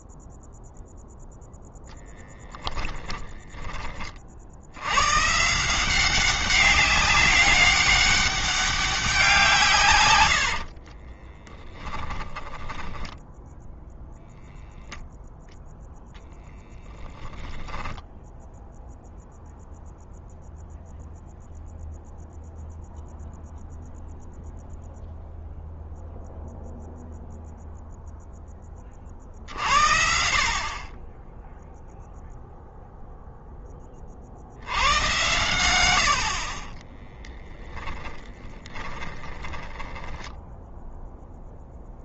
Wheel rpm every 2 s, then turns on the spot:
0, 10, 100, 190, 200, 60, 10, 0, 0, 0, 0, 0, 0, 0, 40, 30, 0, 80, 20, 30, 0.
2-4 10-14 36-40